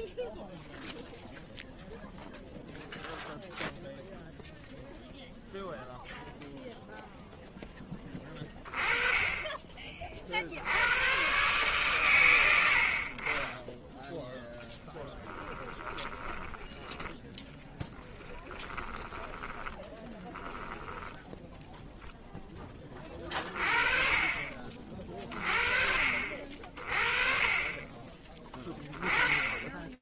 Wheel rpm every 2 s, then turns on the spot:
0, 0, 0, 0, 30, 110, 40, 10, 10, 10, 10, 30, 30, 40, 20.
14-20